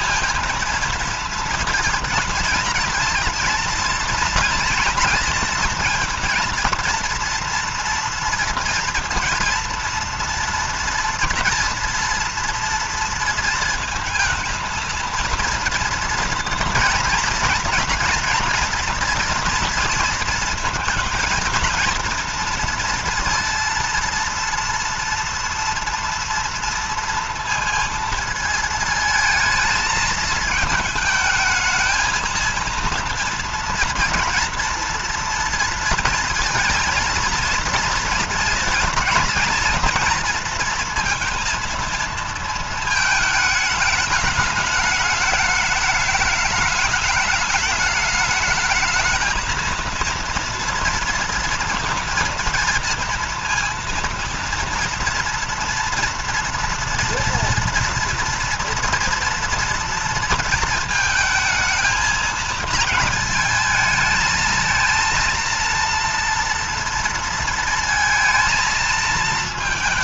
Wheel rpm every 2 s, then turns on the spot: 230, 230, 230, 230, 230, 230, 230, 230, 240, 230, 230, 230, 230, 230, 220, 220, 230, 230, 230, 230, 230, 220, 210, 210, 220, 230, 230, 230, 230, 230, 230, 230, 230, 230, 220.
none